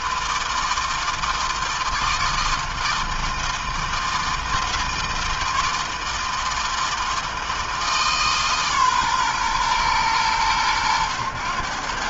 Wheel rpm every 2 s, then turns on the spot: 160, 160, 160, 160, 130, 100.
none